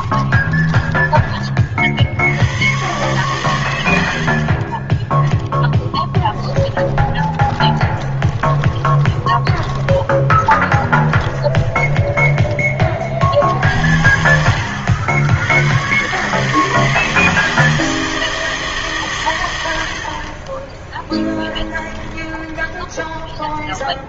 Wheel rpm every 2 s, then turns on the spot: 20, 110, 40, 10, 20, 20, 30, 80, 160, 150, 20, 20.
0-2 6-12 20-24